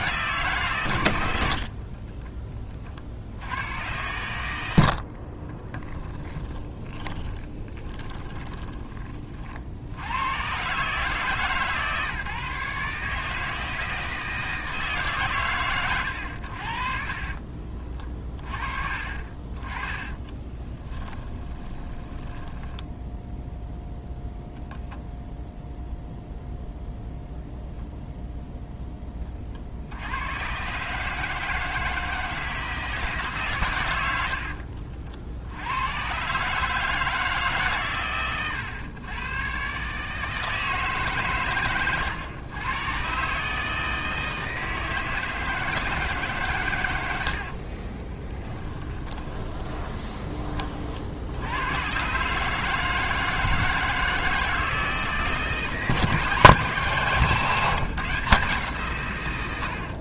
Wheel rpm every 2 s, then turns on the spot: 130, 50, 80, 20, 20, 130, 150, 150, 50, 30, 20, 10, 0, 0, 10, 140, 160, 50, 150, 110, 150, 120, 160, 100, 20, 40, 150, 160, 170, 140.
4-8 16-18 20-24 48-50